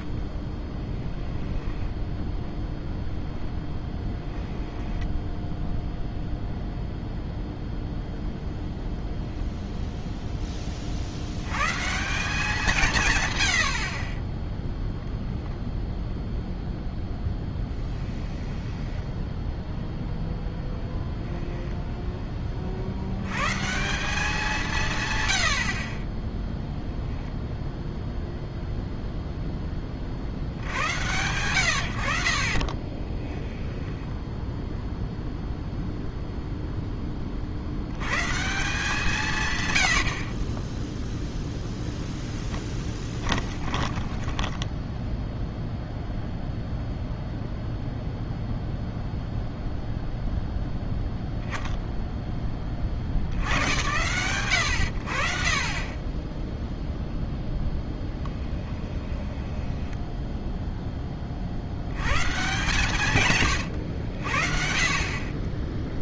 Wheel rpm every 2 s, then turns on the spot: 10, 10, 10, 0, 0, 30, 170, 10, 0, 10, 0, 40, 170, 0, 0, 90, 30, 0, 10, 160, 10, 10, 10, 0, 0, 0, 50, 100, 0, 10, 0, 140, 60.
0-2 4-6 18-20 32-34 42-46 58-60